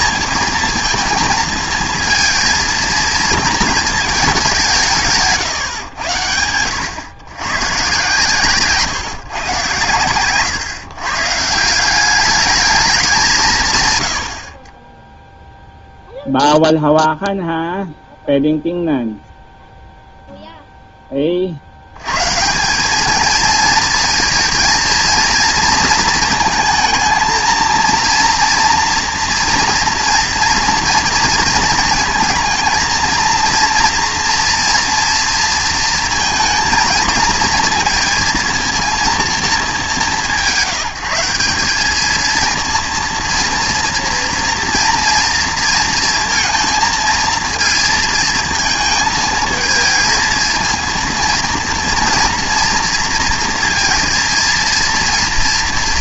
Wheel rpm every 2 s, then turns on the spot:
230, 230, 180, 100, 130, 130, 210, 30, 0, 0, 0, 190, 230, 230, 230, 230, 220, 230, 230, 230, 170, 230, 230, 230, 220, 230, 230, 230.
none